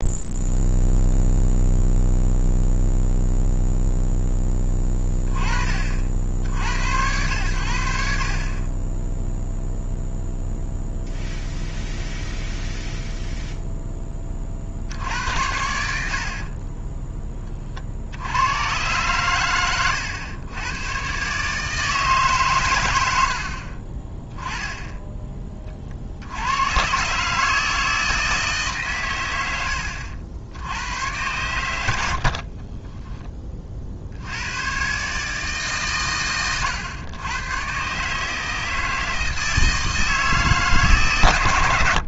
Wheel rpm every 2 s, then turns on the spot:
0, 0, 20, 80, 20, 0, 0, 60, 30, 120, 110, 120, 10, 110, 140, 80, 30, 110, 110, 160, 150.
16-18 32-34